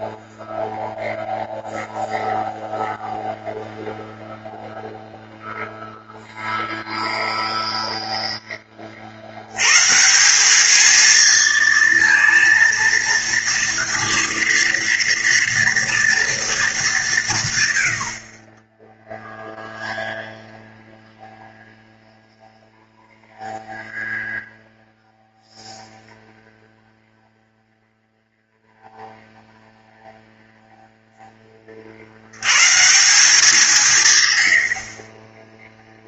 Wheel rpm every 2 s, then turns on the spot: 0, 0, 0, 0, 10, 190, 230, 230, 230, 40, 0, 0, 0, 0, 0, 0, 100, 130.
none